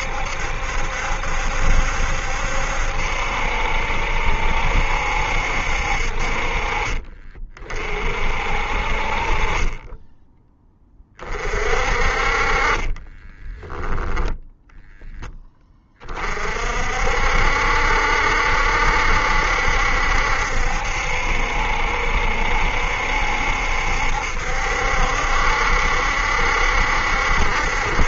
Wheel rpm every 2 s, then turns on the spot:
70, 70, 70, 30, 40, 30, 20, 0, 60, 70, 70, 70, 70, 70.
12-14